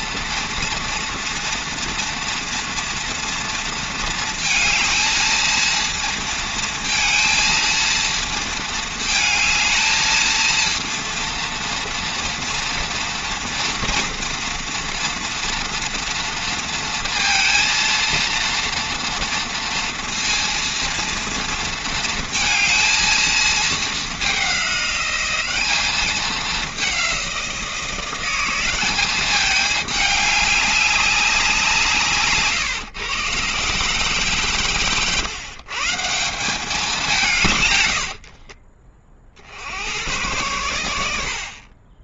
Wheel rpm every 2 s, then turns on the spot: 230, 230, 220, 230, 220, 230, 240, 240, 230, 240, 230, 230, 200, 190, 190, 200, 120, 120, 180, 40, 100.
none